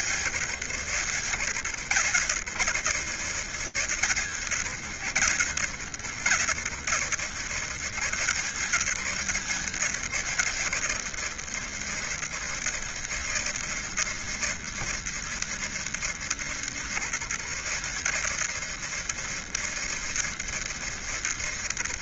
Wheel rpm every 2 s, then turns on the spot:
80, 80, 80, 80, 90, 80, 80, 80, 80, 80, 80.
none